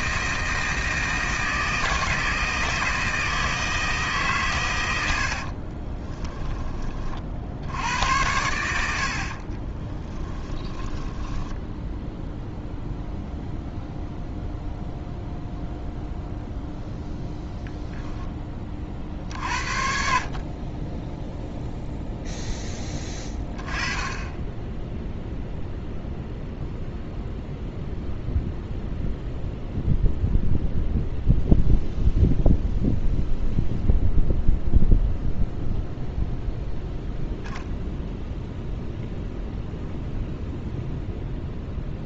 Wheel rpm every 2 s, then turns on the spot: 160, 160, 100, 30, 80, 20, 0, 0, 0, 30, 20, 10, 0, 0, 0, 0, 0, 0, 0, 0, 0.
10-12